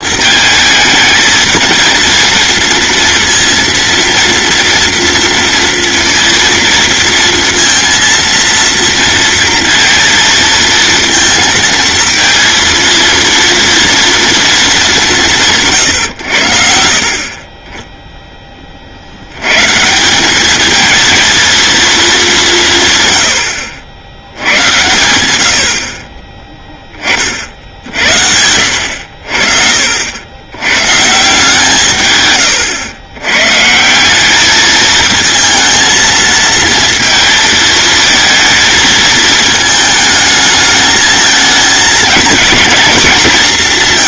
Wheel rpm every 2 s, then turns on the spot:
220, 230, 230, 230, 230, 230, 230, 210, 70, 50, 220, 160, 110, 10, 80, 120, 110, 220, 230, 220, 220, 220.
28-30